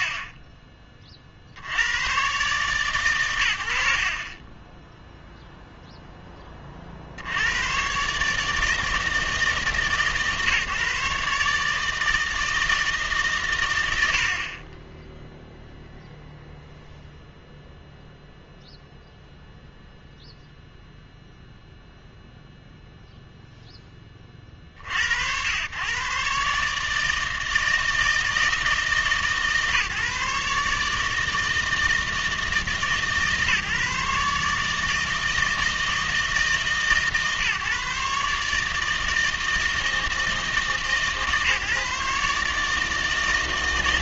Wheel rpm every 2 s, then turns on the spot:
30, 140, 20, 30, 160, 150, 160, 20, 0, 0, 0, 0, 50, 150, 160, 150, 150, 150, 150, 160, 150, 150.
none